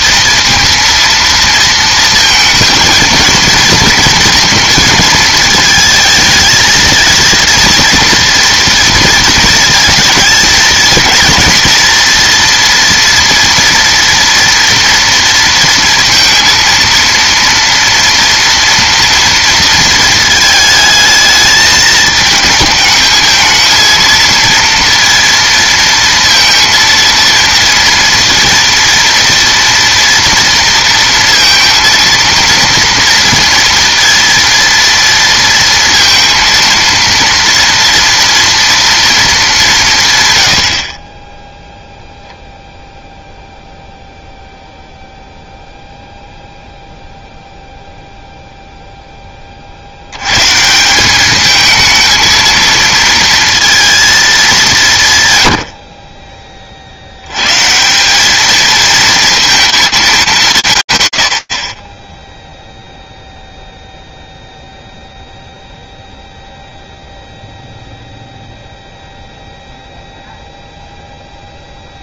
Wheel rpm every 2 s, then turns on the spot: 230, 220, 230, 220, 230, 220, 230, 230, 230, 240, 220, 220, 230, 230, 230, 230, 230, 230, 230, 230, 90, 0, 0, 0, 0, 150, 230, 180, 40, 220, 160, 0, 0, 0, 0, 0.
none